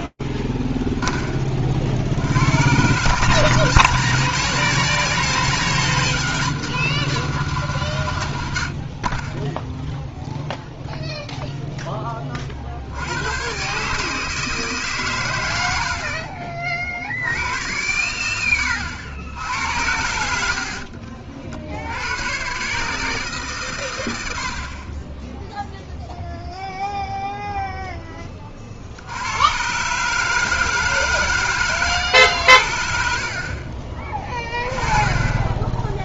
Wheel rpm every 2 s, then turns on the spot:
40, 170, 200, 180, 0, 10, 130, 80, 100, 80, 70, 120, 0, 0, 120, 140, 30, 0.
32-34